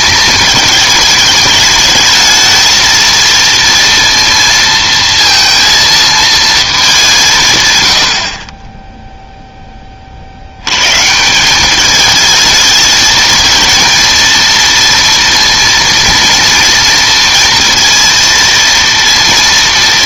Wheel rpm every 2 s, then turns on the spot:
210, 230, 230, 210, 20, 100, 220, 230, 230, 230.
none